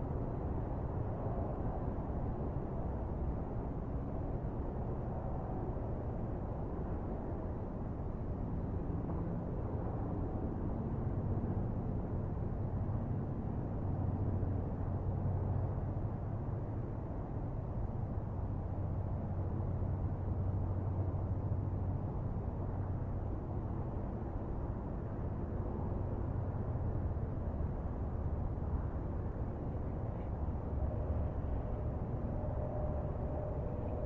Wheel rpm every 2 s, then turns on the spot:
0, 0, 0, 0, 0, 0, 0, 0, 0, 0, 0, 0, 0, 0, 0, 0, 0.
none